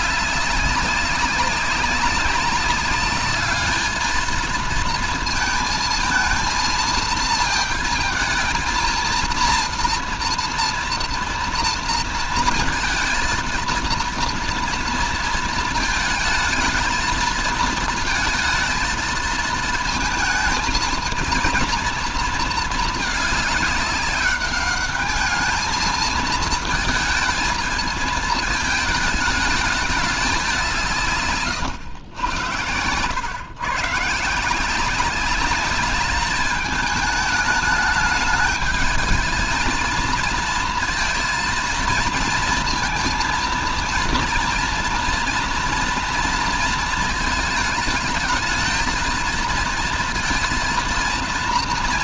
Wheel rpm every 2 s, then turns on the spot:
200, 200, 230, 230, 230, 230, 220, 230, 220, 220, 230, 220, 200, 220, 220, 170, 100, 170, 210, 220, 230, 230, 230, 230, 220, 230.
none